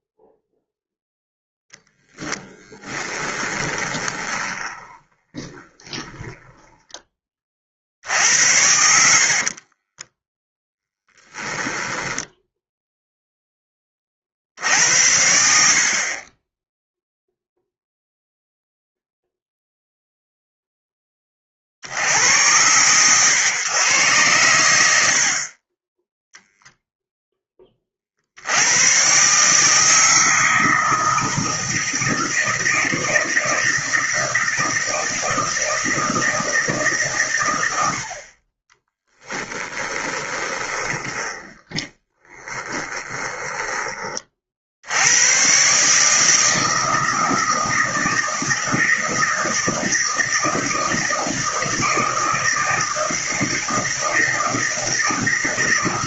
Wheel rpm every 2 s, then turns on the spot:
0, 10, 20, 10, 70, 10, 0, 70, 10, 0, 10, 110, 90, 0, 100, 160, 160, 160, 150, 20, 30, 20, 60, 160, 160, 160, 160, 160.
2-8 10-12 38-44